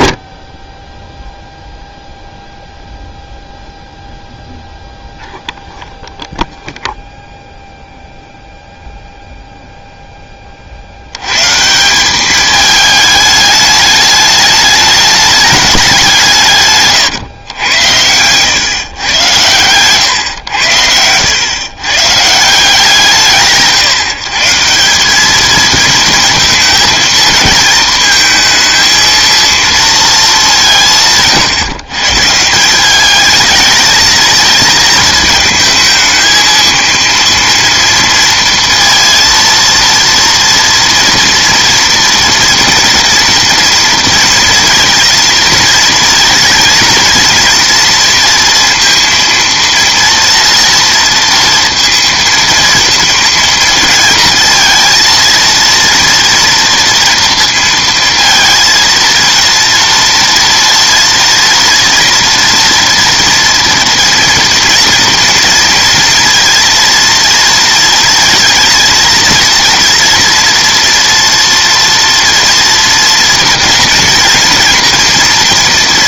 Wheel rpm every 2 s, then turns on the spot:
10, 0, 0, 0, 0, 40, 210, 210, 150, 130, 100, 160, 170, 220, 220, 180, 180, 220, 230, 230, 230, 230, 230, 230, 230, 230, 230, 220, 230, 230, 230, 230, 230, 230, 230, 230, 230, 230.
20-22